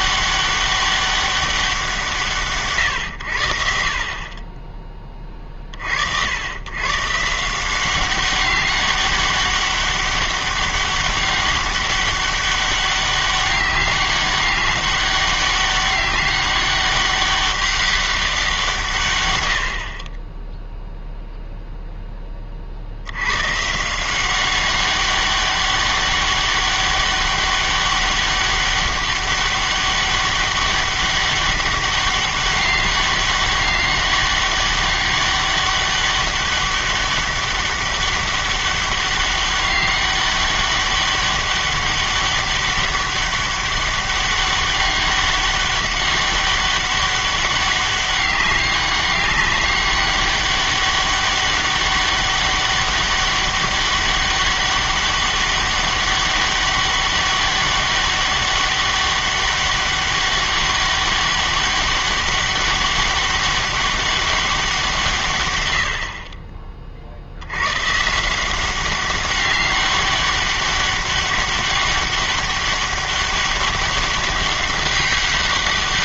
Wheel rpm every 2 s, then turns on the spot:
200, 130, 20, 110, 200, 200, 200, 200, 200, 170, 0, 50, 190, 200, 200, 200, 200, 200, 200, 200, 200, 200, 200, 200, 200, 200, 200, 200, 200, 200, 200, 200, 180, 40, 190, 200, 200, 200.
none